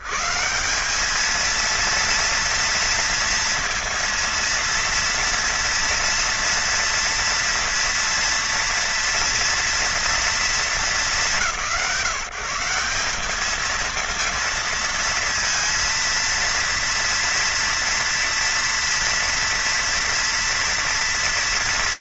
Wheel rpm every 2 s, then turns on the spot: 140, 230, 230, 230, 230, 180, 180, 230, 230, 230, 230.
none